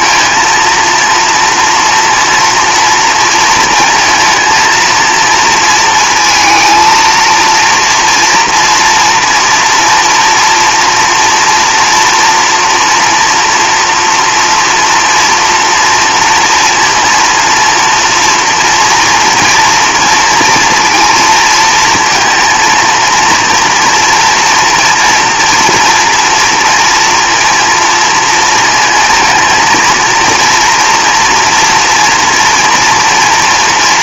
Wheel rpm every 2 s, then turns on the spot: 230, 240, 230, 230, 230, 230, 240, 240, 230, 230, 230, 230, 230, 230, 230, 230, 230.
none